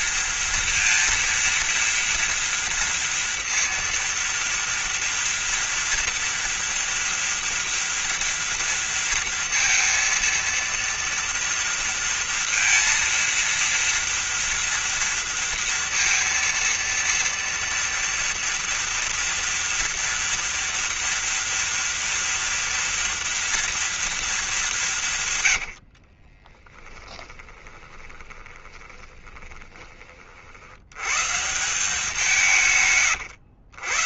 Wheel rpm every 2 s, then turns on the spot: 230, 230, 230, 230, 230, 230, 230, 230, 230, 230, 230, 230, 160, 10, 20, 120, 120.
26-30